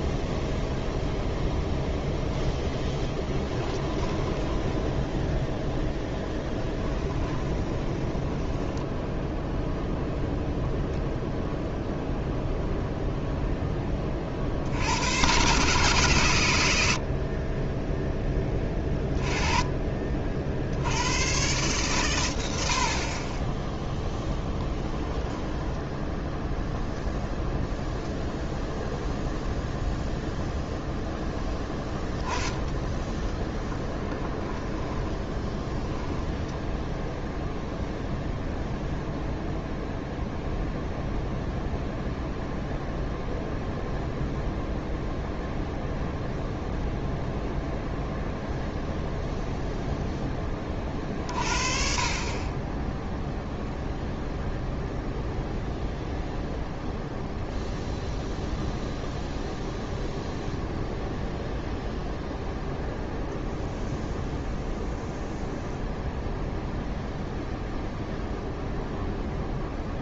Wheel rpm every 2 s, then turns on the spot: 0, 0, 10, 10, 10, 0, 0, 50, 110, 10, 70, 90, 0, 0, 0, 0, 10, 10, 10, 0, 0, 0, 0, 0, 0, 10, 30, 0, 0, 0, 0, 0, 0, 0, 0.
4-10 34-38